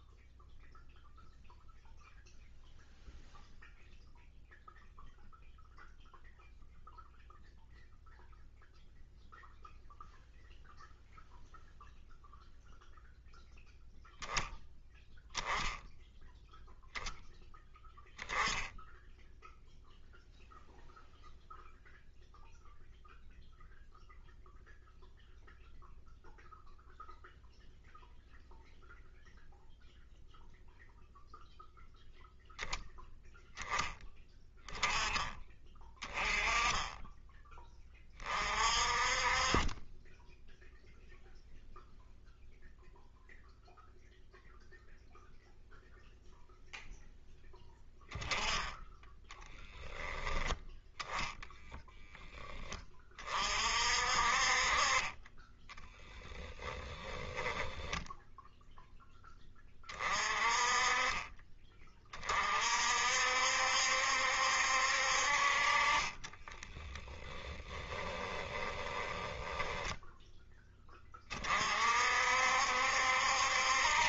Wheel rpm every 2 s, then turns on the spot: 0, 0, 0, 0, 0, 0, 0, 0, 0, 0, 0, 0, 0, 0, 0, 0, 0, 10, 10, 40, 0, 0, 0, 10, 20, 10, 20, 40, 10, 0, 30, 50, 60, 20, 20, 10, 60.
66-70